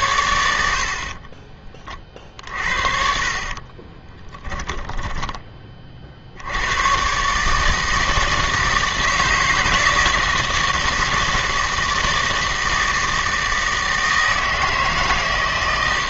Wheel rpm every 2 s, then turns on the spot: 70, 50, 10, 110, 160, 160, 160, 160.
2-6